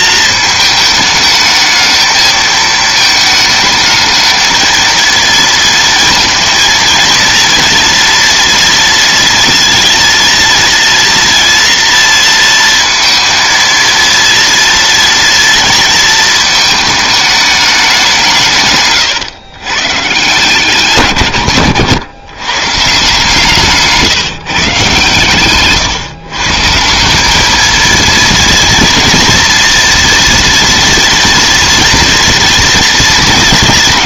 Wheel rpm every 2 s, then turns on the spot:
220, 220, 220, 230, 230, 230, 230, 240, 220, 140, 160, 140, 130, 150, 230, 230, 230.
none